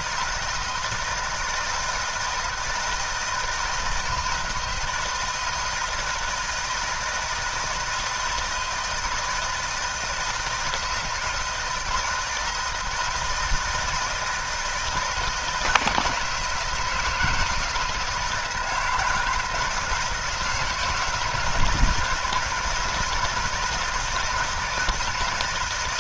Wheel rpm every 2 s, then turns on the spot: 160, 160, 160, 160, 160, 160, 160, 160, 160, 160, 160, 170, 160.
none